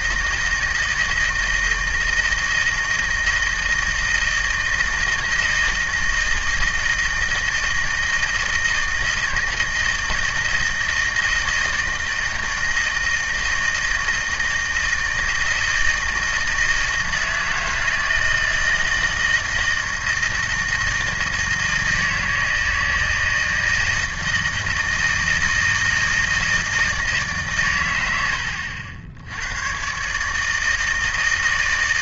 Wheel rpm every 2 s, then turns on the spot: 160, 160, 160, 160, 160, 160, 160, 160, 160, 160, 160, 160, 160, 160, 70, 160.
none